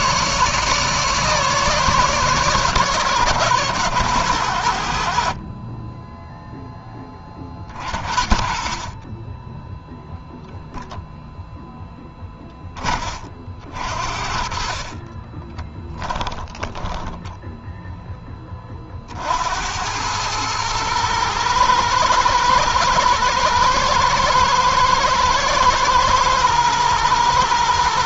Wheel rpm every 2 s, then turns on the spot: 150, 130, 80, 10, 50, 0, 20, 40, 10, 20, 110, 110, 110, 120.
16-18